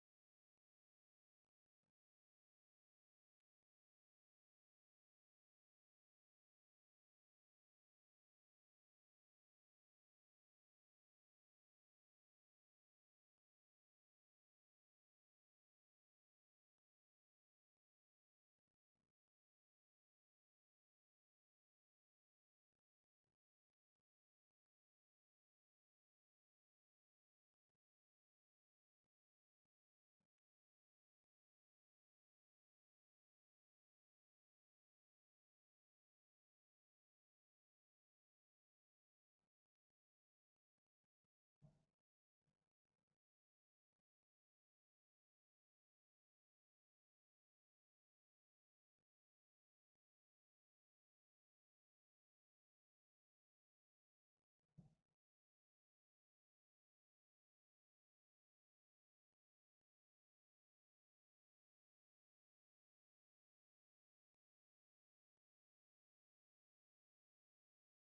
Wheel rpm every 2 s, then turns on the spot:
0, 0, 0, 0, 0, 0, 0, 0, 0, 0, 0, 0, 0, 0, 0, 0, 0, 0, 0, 0, 0, 0, 0, 0, 0, 0, 0, 0, 0, 0, 0, 0, 0, 0.
none